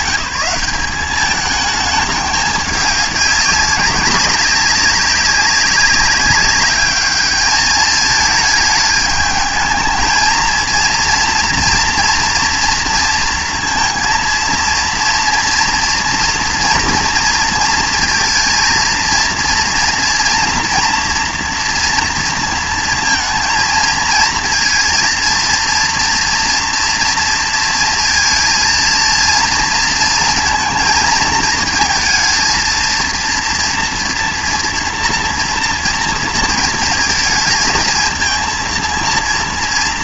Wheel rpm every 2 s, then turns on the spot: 200, 210, 200, 200, 220, 230, 230, 230, 230, 230, 240, 230, 230, 230, 230, 220, 220, 230, 220, 220.
none